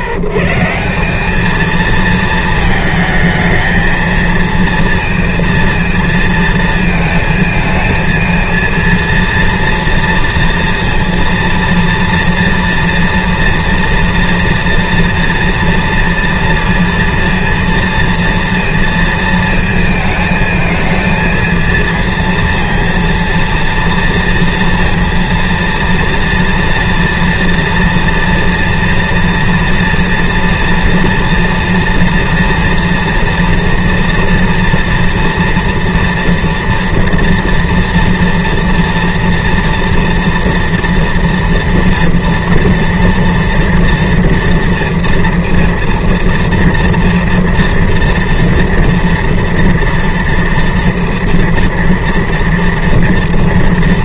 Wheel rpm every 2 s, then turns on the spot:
90, 220, 230, 230, 230, 230, 230, 230, 230, 230, 220, 230, 230, 230, 230, 230, 240, 240, 240, 230, 230, 240, 230, 230, 230, 230, 230.
none